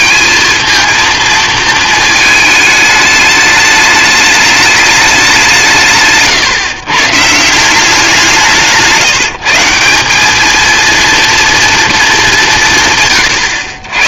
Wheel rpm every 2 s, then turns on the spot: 230, 220, 210, 150, 170, 220, 150.
none